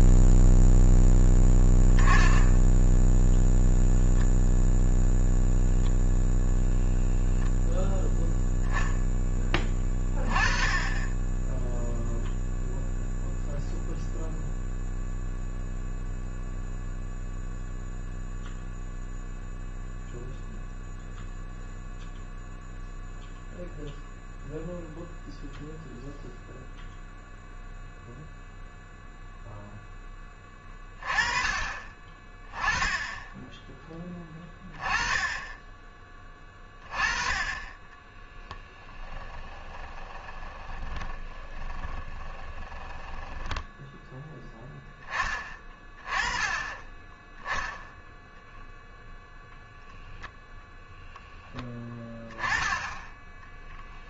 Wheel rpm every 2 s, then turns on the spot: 0, 0, 0, 0, 10, 20, 0, 0, 0, 0, 0, 0, 0, 0, 0, 20, 10, 20, 20, 10, 20, 10, 10, 20, 10, 10, 10.
38-44